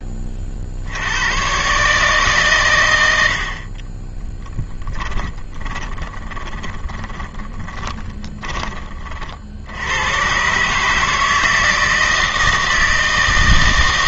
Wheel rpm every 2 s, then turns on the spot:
70, 120, 20, 20, 30, 140, 160.
4-8